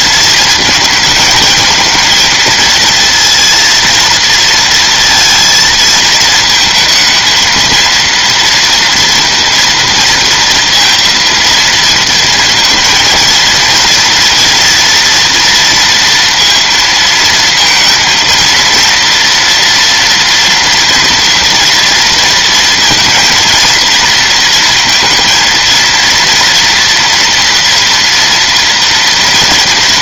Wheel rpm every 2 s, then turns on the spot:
220, 220, 230, 220, 230, 230, 230, 230, 230, 230, 230, 230, 230, 230, 230.
none